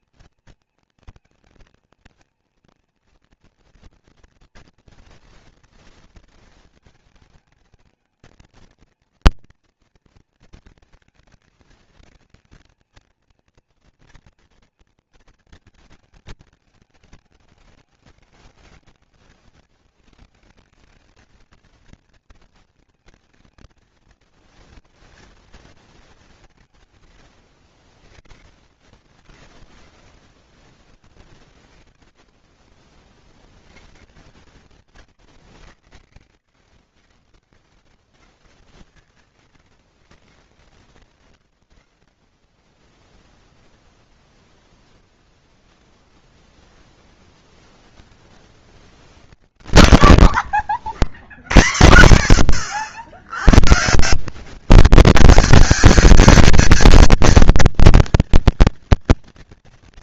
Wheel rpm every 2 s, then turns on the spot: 220, 230, 230, 220, 230, 220, 230, 230, 210, 210, 220, 230, 220, 110, 150, 180, 50, 130, 110, 130, 130, 10, 10, 0, 70, 70, 90, 210, 230, 230.
26-28 44-46